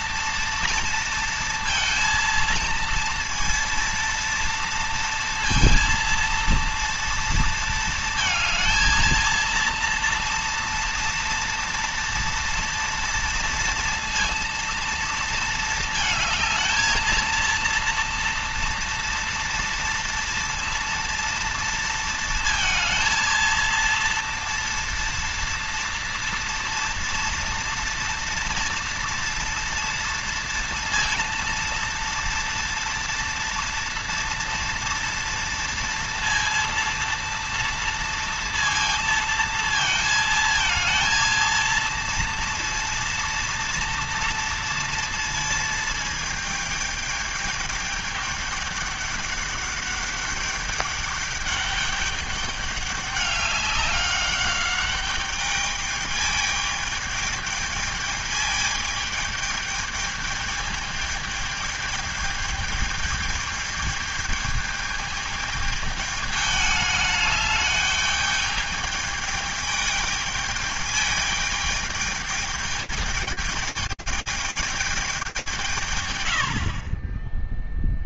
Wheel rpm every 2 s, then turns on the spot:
230, 230, 230, 230, 220, 230, 230, 230, 220, 230, 230, 230, 230, 230, 230, 230, 230, 240, 230, 230, 230, 230, 230, 220, 210, 210, 200, 200, 210, 210, 210, 210, 210, 210, 210, 210, 210, 210, 70.
none